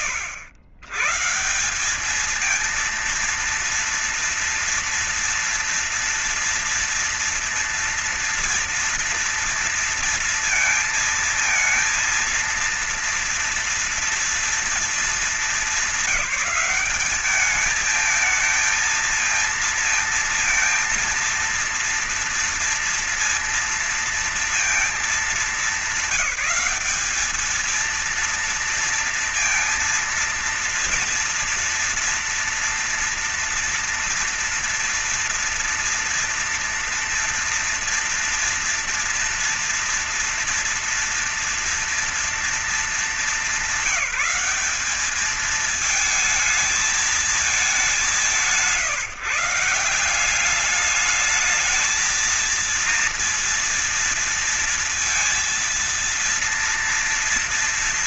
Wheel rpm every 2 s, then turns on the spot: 110, 230, 230, 230, 230, 230, 230, 220, 190, 220, 230, 230, 220, 200, 230, 230, 230, 230, 230, 230, 230, 230, 210, 220, 160, 200, 230, 230, 230.
none